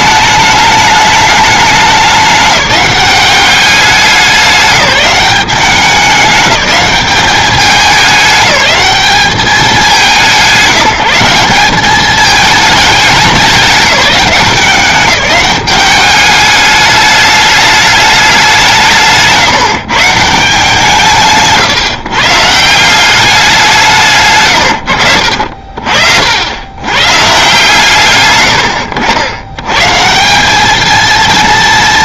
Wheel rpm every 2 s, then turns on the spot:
210, 200, 190, 200, 210, 180, 200, 190, 210, 180, 150, 180, 90, 130, 80, 220.
none